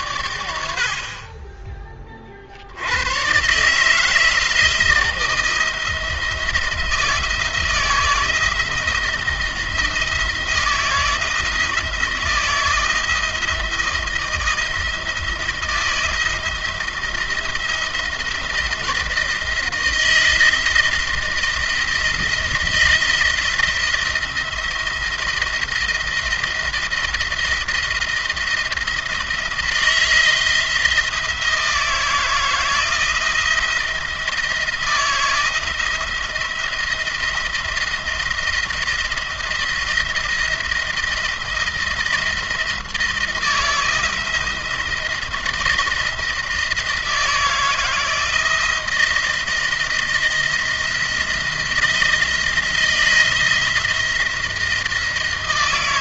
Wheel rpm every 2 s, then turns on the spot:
80, 60, 170, 160, 160, 160, 160, 160, 170, 170, 160, 160, 170, 170, 170, 170, 170, 160, 170, 170, 170, 160, 170, 160, 160, 170, 170, 170.
none